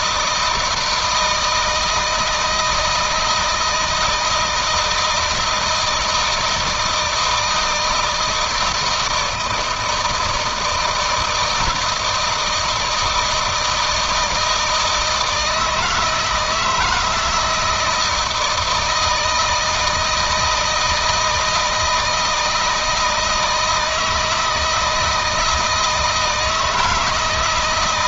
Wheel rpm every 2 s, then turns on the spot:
160, 160, 160, 160, 160, 160, 170, 160, 160, 160, 160, 160, 160, 160.
none